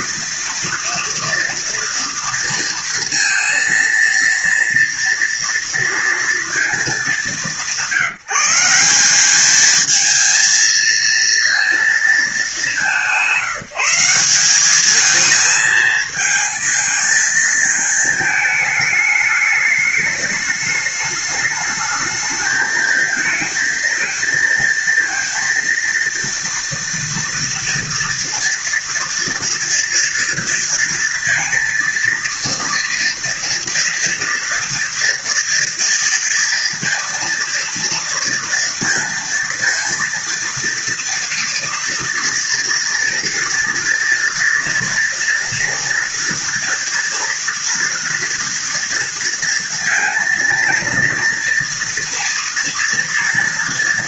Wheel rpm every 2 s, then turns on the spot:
230, 230, 230, 200, 200, 230, 180, 220, 220, 210, 210, 220, 230, 230, 230, 230, 230, 240, 230, 230, 230, 230, 230, 230, 230, 240, 230.
none